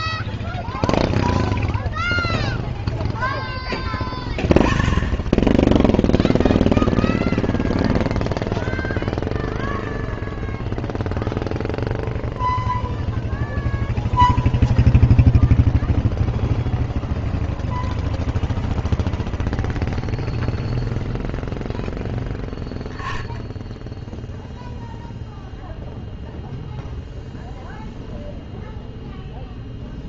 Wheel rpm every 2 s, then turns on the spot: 0, 0, 10, 0, 0, 0, 0, 0, 0, 0, 0, 10, 0, 0, 0.
none